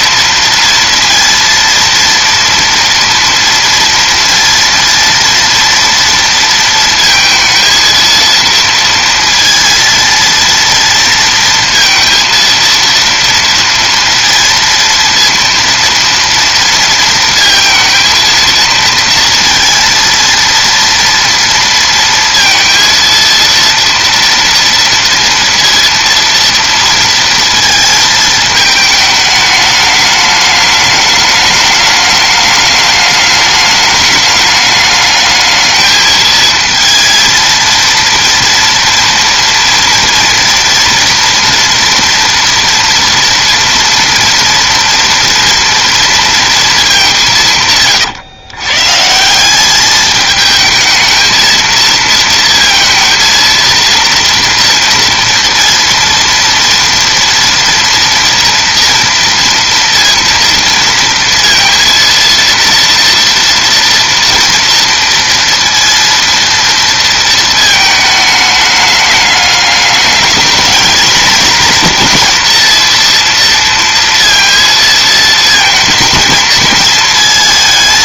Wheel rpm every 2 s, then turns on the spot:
230, 240, 230, 220, 230, 230, 230, 230, 230, 230, 230, 230, 230, 230, 220, 210, 210, 210, 230, 230, 230, 230, 230, 210, 130, 220, 230, 230, 230, 230, 230, 230, 230, 230, 210, 220, 230, 230, 220.
none